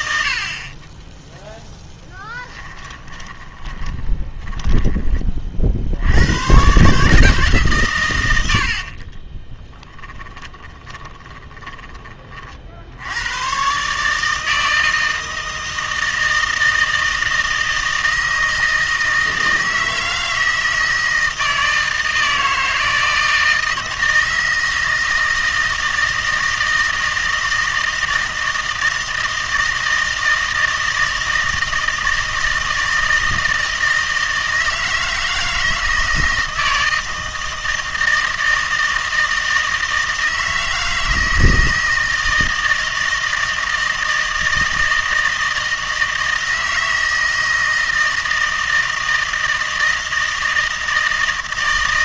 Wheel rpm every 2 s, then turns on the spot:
40, 10, 10, 110, 70, 20, 50, 160, 160, 160, 160, 160, 160, 160, 160, 160, 160, 160, 160, 160, 160, 160, 160, 160, 160, 160.
2-6 8-12